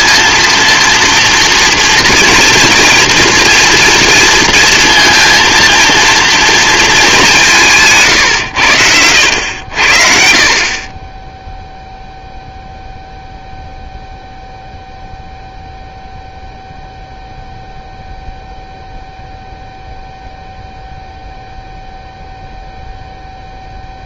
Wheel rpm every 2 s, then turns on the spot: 230, 230, 230, 230, 110, 40, 0, 0, 0, 0, 0, 0.
8-10